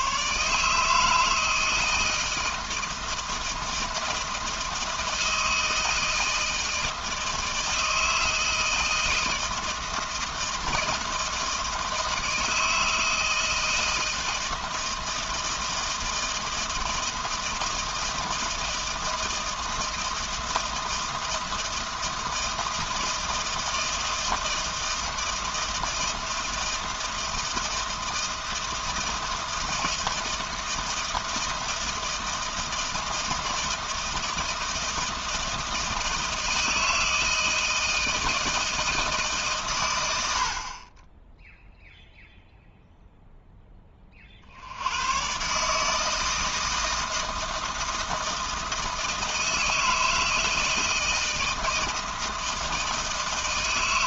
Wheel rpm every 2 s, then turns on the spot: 160, 160, 160, 160, 160, 160, 160, 160, 160, 160, 160, 160, 160, 160, 160, 160, 160, 160, 160, 160, 40, 0, 90, 160, 160, 160, 160.
none